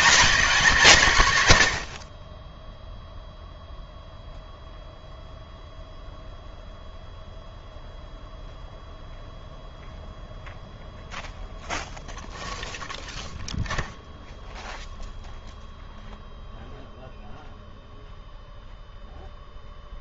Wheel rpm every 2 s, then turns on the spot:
180, 10, 0, 0, 0, 0, 0, 0, 0, 0.
none